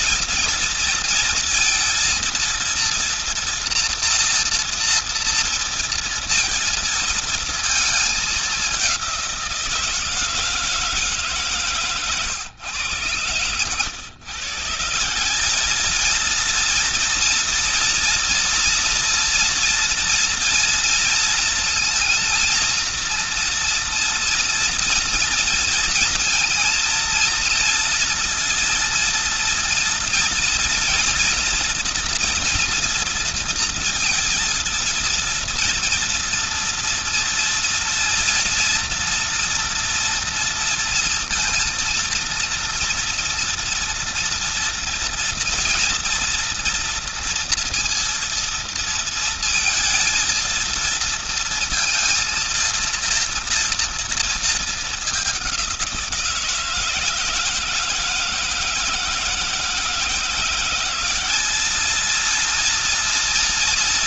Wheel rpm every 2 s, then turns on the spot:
230, 230, 230, 230, 200, 160, 120, 140, 230, 240, 230, 230, 230, 230, 230, 230, 230, 230, 230, 230, 230, 230, 230, 240, 230, 230, 230, 220, 170, 160, 180, 230.
none